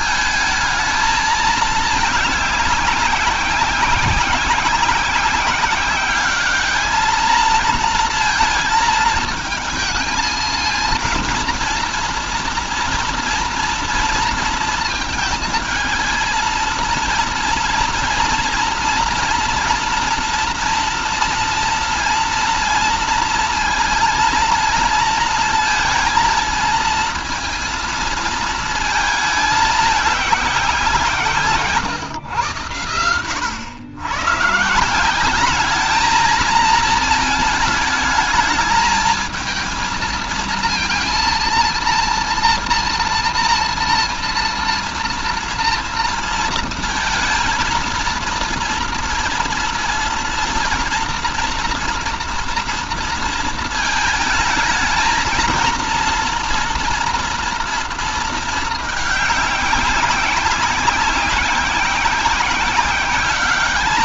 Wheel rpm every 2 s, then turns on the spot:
220, 200, 190, 210, 230, 220, 240, 230, 230, 230, 230, 230, 230, 220, 220, 190, 100, 140, 230, 220, 230, 230, 230, 230, 230, 230, 230, 220, 230, 220, 190, 190.
none